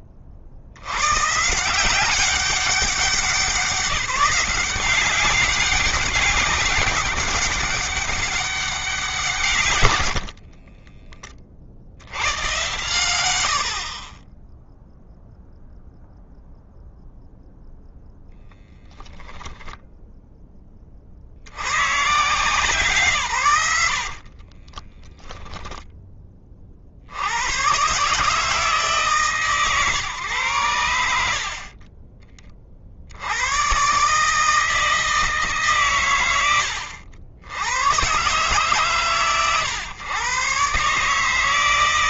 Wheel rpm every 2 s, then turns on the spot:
140, 190, 190, 190, 160, 30, 90, 0, 0, 10, 30, 130, 10, 90, 150, 70, 90, 160, 90, 130, 140.
24-26